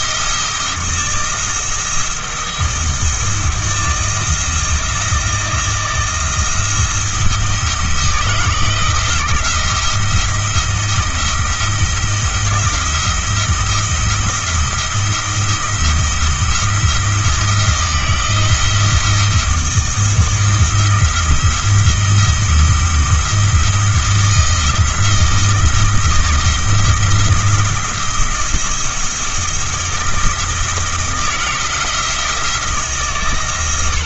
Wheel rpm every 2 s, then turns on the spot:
160, 170, 170, 170, 160, 170, 170, 170, 160, 160, 170, 170, 170, 170, 170, 170, 160.
none